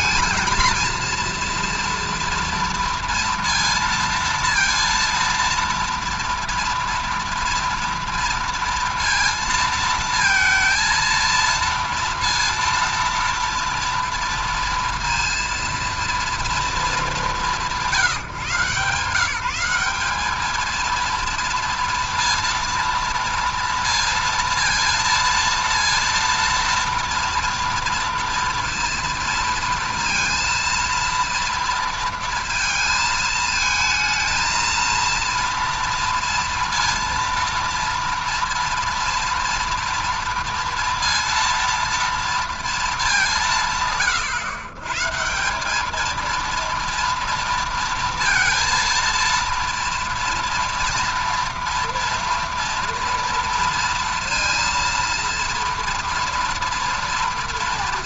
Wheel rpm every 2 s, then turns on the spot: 220, 230, 230, 230, 230, 230, 230, 230, 210, 150, 220, 230, 230, 230, 230, 230, 220, 230, 230, 230, 230, 230, 120, 230, 230, 230, 240, 230, 230.
none